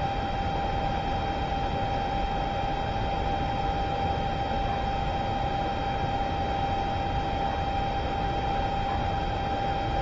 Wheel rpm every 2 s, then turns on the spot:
0, 0, 0, 0, 0.
none